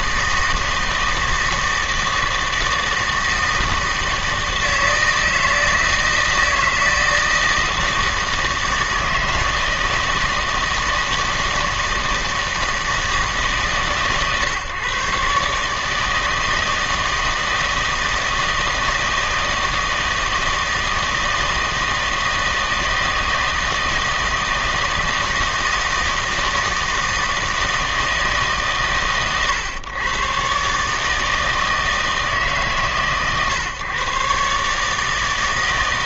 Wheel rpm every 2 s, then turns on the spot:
160, 160, 160, 160, 160, 160, 160, 130, 160, 160, 160, 160, 160, 160, 140, 140, 140, 150.
none